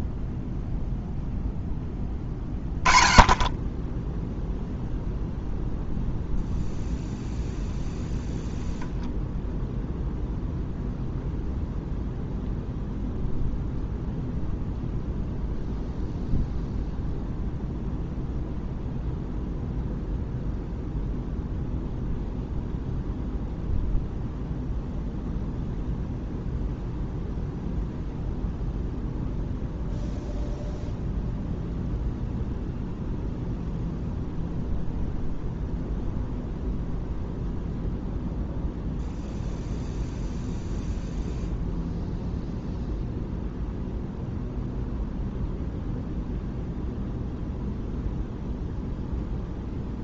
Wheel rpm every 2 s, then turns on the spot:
0, 10, 0, 0, 0, 0, 0, 0, 0, 0, 0, 0, 0, 0, 0, 0, 0, 0, 0, 0, 0, 0, 0, 0, 0.
none